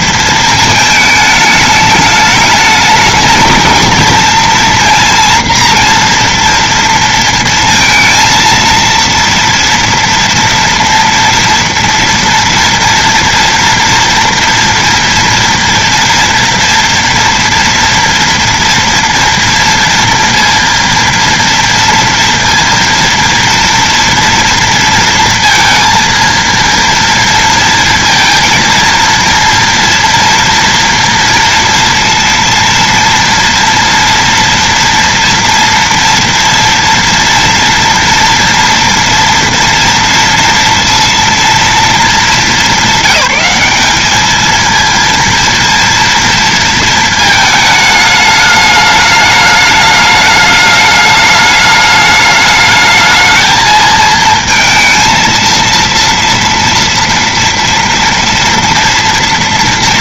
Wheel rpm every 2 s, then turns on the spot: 230, 210, 230, 230, 230, 230, 230, 230, 230, 230, 240, 230, 230, 230, 230, 230, 230, 230, 240, 230, 230, 220, 210, 230, 210, 210, 210, 220, 230, 230.
none